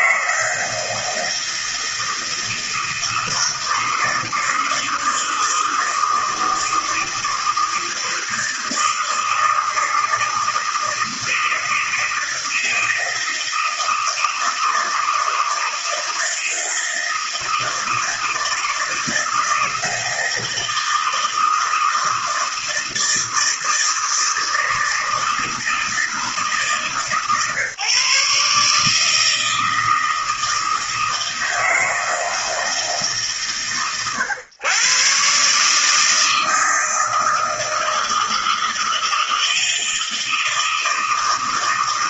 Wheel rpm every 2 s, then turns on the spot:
160, 160, 160, 160, 160, 160, 160, 160, 160, 160, 160, 160, 160, 140, 160, 170, 130, 130, 160, 160, 160.
none